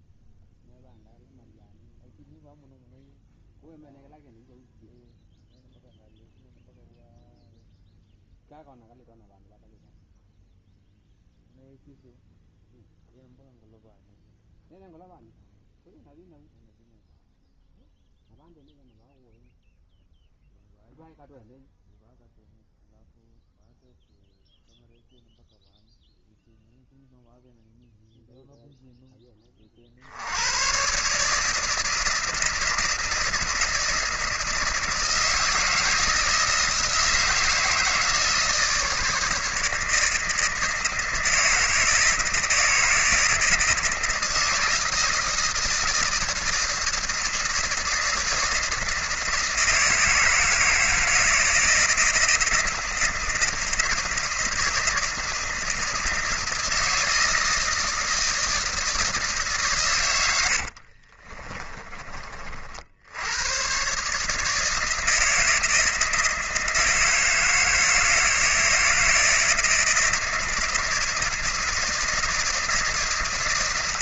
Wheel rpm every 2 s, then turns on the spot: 0, 0, 0, 0, 0, 0, 0, 0, 0, 0, 0, 0, 0, 0, 10, 140, 160, 160, 160, 150, 160, 160, 160, 160, 160, 160, 160, 160, 160, 150, 40, 80, 160, 160, 160, 160, 160.
60-62